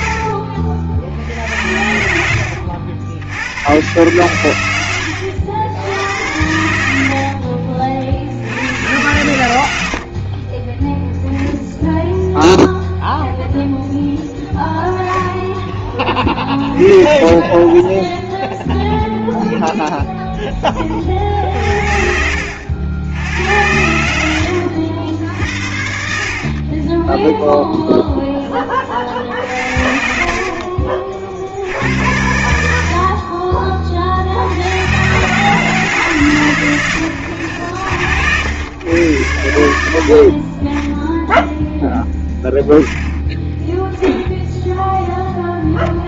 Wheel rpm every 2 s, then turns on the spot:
60, 100, 90, 60, 100, 0, 0, 0, 20, 0, 60, 90, 70, 10, 50, 60, 50, 130, 80, 90, 0, 10, 0.
0-2 6-8 26-30